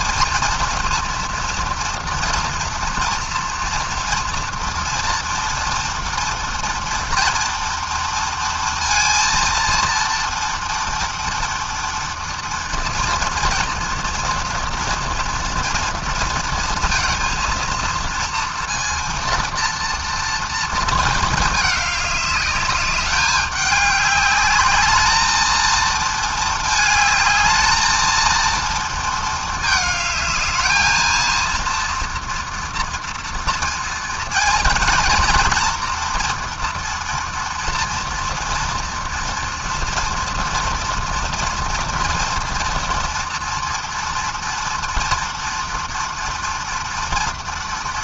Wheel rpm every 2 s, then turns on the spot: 230, 230, 230, 230, 230, 230, 230, 230, 230, 230, 220, 200, 220, 210, 230, 230, 230, 230, 240, 230, 230, 230, 230, 230.
none